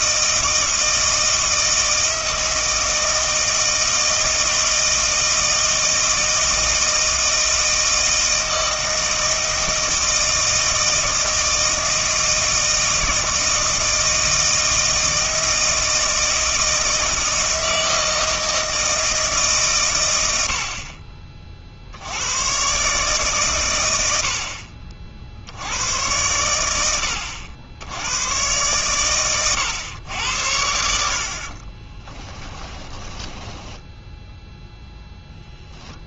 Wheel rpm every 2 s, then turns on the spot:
160, 160, 160, 160, 160, 160, 160, 160, 160, 160, 60, 130, 50, 90, 110, 70, 20, 0.
32-34